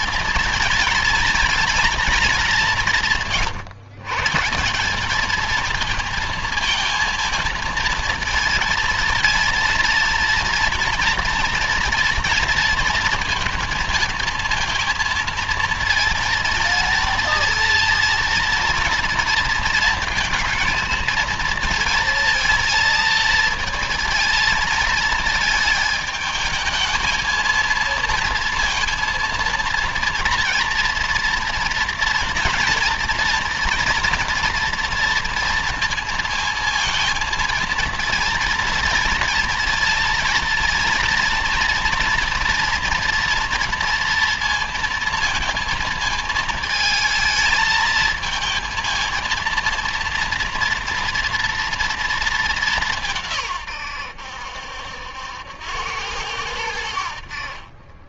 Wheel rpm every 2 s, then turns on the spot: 230, 170, 190, 230, 230, 230, 230, 230, 230, 230, 230, 230, 220, 220, 230, 240, 240, 240, 230, 230, 230, 230, 230, 220, 220, 230, 180, 80, 80.
none